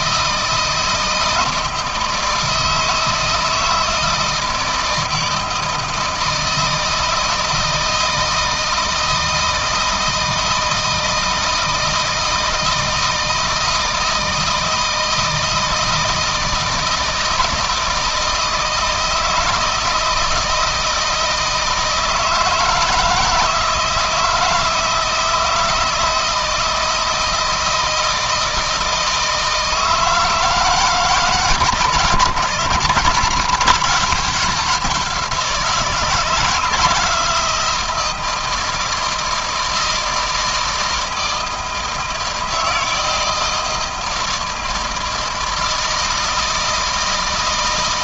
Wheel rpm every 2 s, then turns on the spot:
160, 160, 160, 160, 160, 160, 160, 160, 160, 160, 160, 160, 160, 160, 160, 160, 160, 180, 160, 160, 160, 160, 160, 160.
none